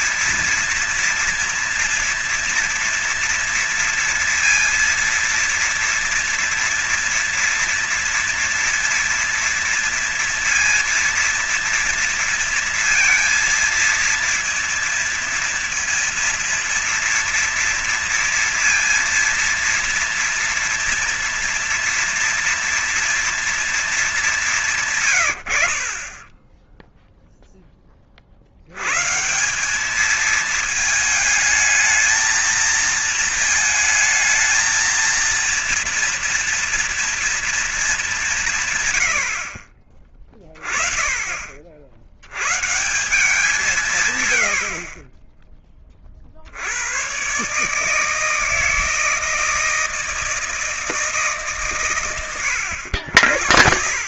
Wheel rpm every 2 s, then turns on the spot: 230, 230, 230, 240, 230, 230, 230, 230, 230, 230, 230, 230, 150, 10, 100, 220, 220, 230, 230, 150, 30, 160, 50, 90, 160, 160, 100.
none